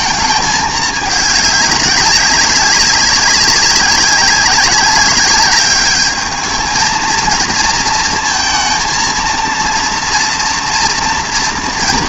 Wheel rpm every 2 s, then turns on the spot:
220, 200, 190, 220, 230, 230.
none